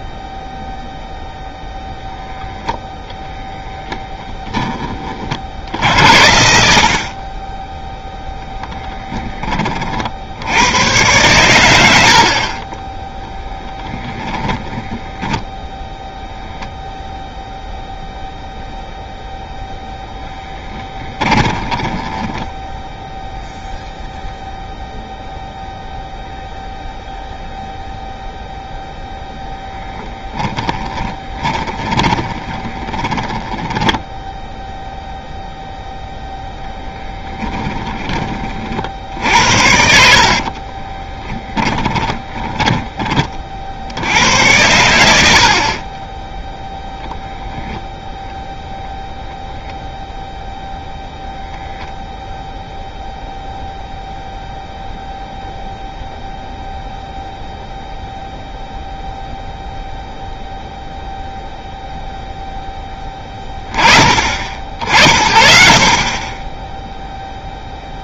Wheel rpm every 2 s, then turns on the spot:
0, 0, 10, 70, 0, 100, 30, 20, 0, 0, 10, 10, 0, 0, 0, 30, 20, 0, 0, 50, 40, 20, 90, 0, 0, 0, 0, 0, 0, 0, 0, 10, 60, 10.
12-16 20-22 30-34 40-42